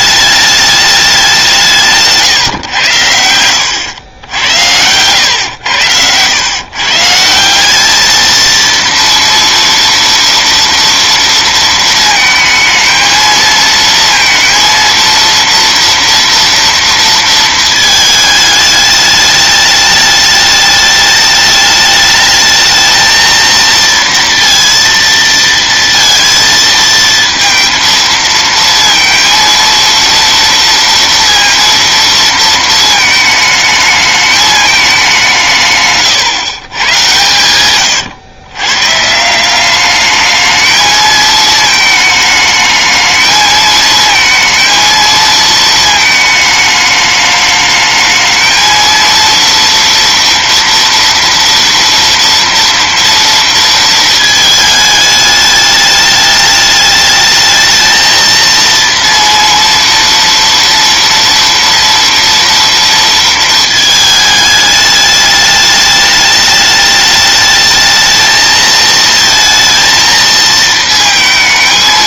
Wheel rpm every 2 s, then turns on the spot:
210, 110, 90, 140, 230, 230, 230, 230, 230, 210, 210, 220, 230, 220, 230, 230, 230, 210, 130, 130, 220, 220, 230, 220, 230, 230, 230, 220, 210, 230, 230, 230, 210, 210, 220, 220.
none